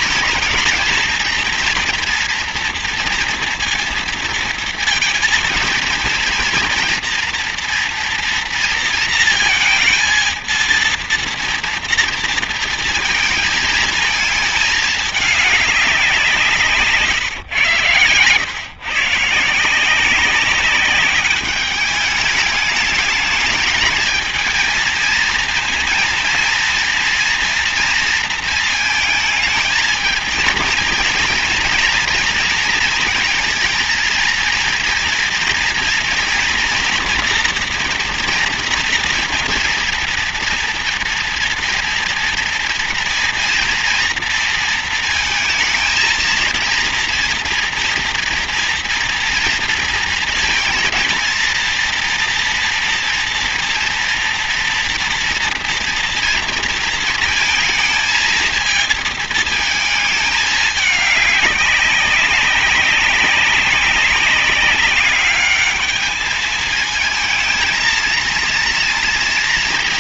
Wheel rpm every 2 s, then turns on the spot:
220, 240, 230, 230, 230, 230, 230, 220, 180, 120, 190, 210, 230, 230, 230, 230, 230, 230, 230, 230, 230, 230, 230, 230, 240, 230, 230, 230, 230, 220, 210, 200, 200, 210, 230.
none